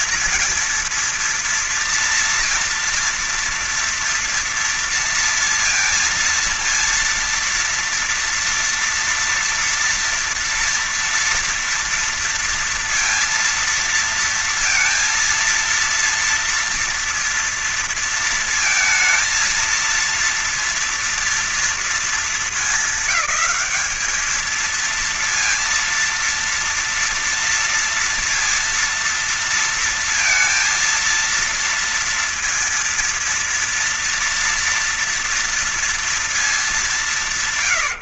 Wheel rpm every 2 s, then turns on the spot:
230, 230, 230, 230, 230, 230, 230, 230, 230, 230, 230, 200, 210, 230, 230, 230, 230, 230, 220.
none